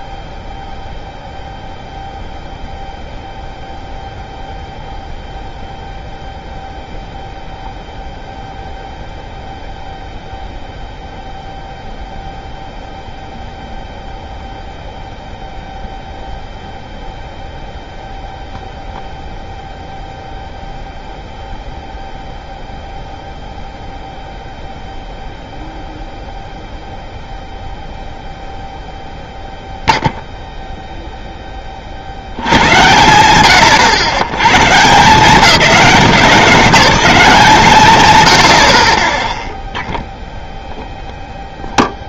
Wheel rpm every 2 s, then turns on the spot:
0, 0, 0, 0, 0, 0, 0, 0, 0, 0, 0, 0, 0, 0, 0, 0, 90, 140, 200, 70, 0.
none